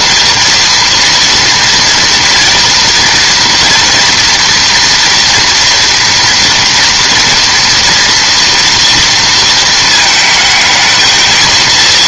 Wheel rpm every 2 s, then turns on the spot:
230, 230, 230, 230, 240, 220.
none